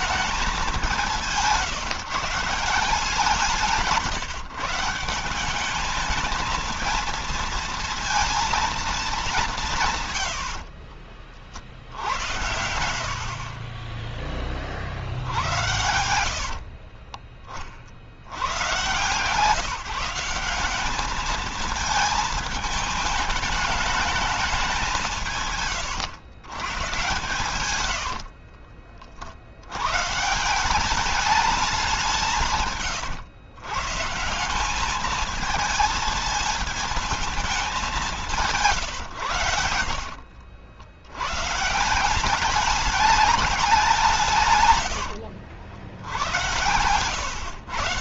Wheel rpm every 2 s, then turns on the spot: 190, 170, 170, 230, 210, 40, 70, 50, 60, 130, 210, 220, 180, 130, 50, 200, 130, 210, 220, 130, 90, 210, 110, 100.
10-12 16-18 26-28 44-46